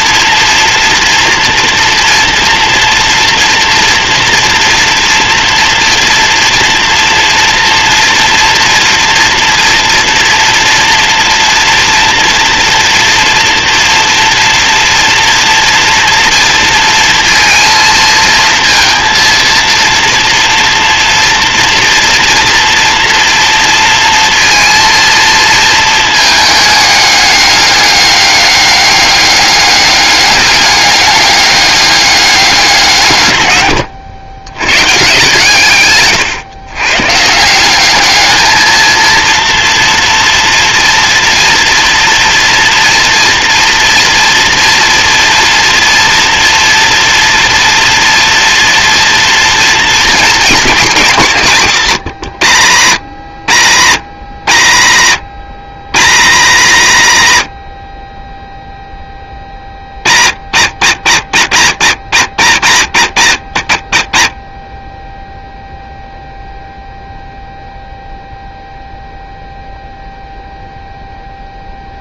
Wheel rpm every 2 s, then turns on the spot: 230, 230, 230, 240, 230, 230, 230, 230, 230, 220, 230, 230, 230, 210, 200, 200, 160, 130, 130, 230, 240, 230, 240, 230, 230, 210, 120, 110, 170, 10, 90, 100, 20, 0, 0, 0.
none